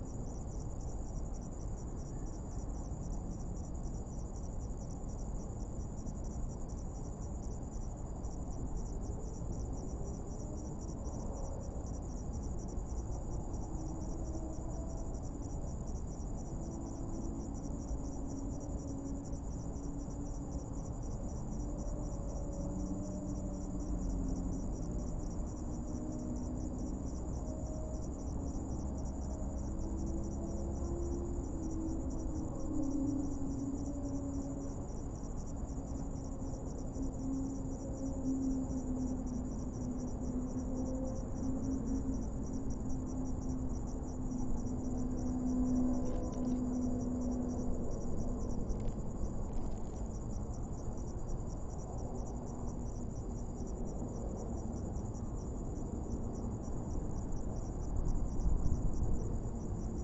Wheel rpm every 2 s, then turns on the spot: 0, 0, 0, 0, 0, 0, 0, 0, 0, 0, 0, 0, 0, 0, 0, 0, 0, 0, 0, 0, 0, 0, 0, 0, 0, 0, 0, 0, 0, 0.
none